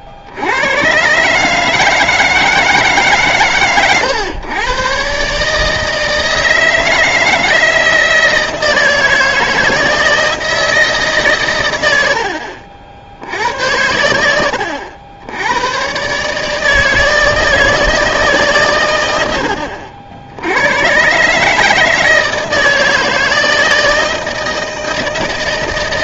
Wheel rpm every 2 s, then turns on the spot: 90, 160, 120, 160, 160, 160, 70, 80, 150, 130, 90, 160, 160.
none